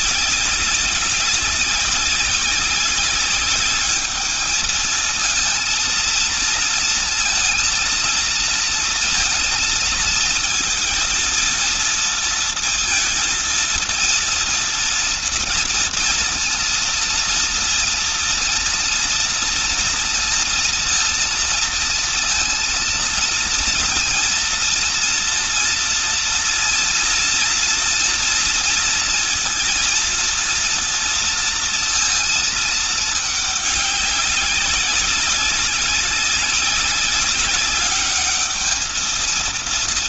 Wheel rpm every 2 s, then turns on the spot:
200, 200, 220, 230, 230, 230, 230, 230, 230, 230, 230, 230, 230, 230, 230, 230, 220, 190, 200, 220.
none